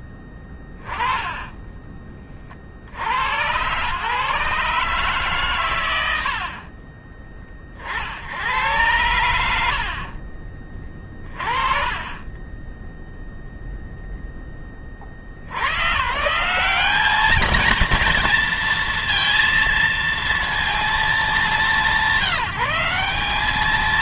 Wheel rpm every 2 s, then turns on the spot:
10, 40, 140, 70, 80, 40, 30, 10, 160, 220, 230, 180.
6-8